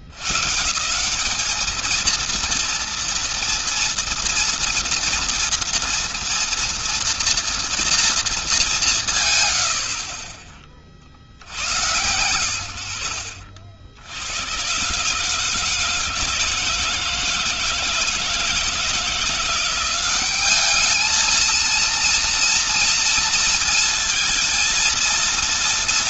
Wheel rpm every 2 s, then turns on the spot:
110, 230, 230, 230, 230, 50, 100, 70, 160, 160, 190, 230, 230.
10-12